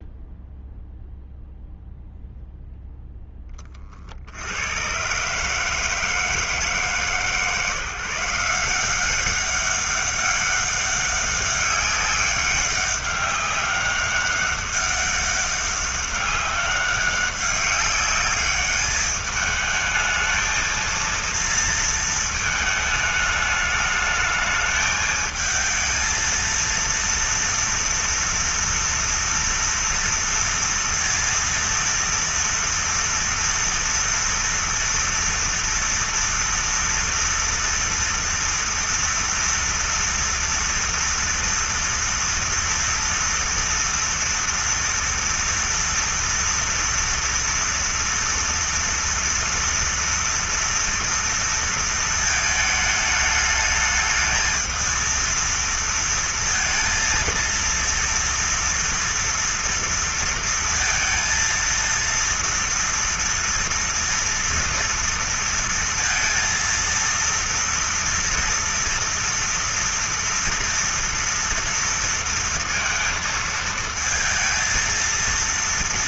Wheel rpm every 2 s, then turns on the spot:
0, 0, 120, 160, 180, 200, 190, 200, 200, 210, 230, 220, 220, 230, 230, 230, 230, 230, 230, 230, 230, 230, 230, 230, 230, 230, 220, 220, 230, 230, 230, 230, 230, 230, 230, 230, 230, 230.
none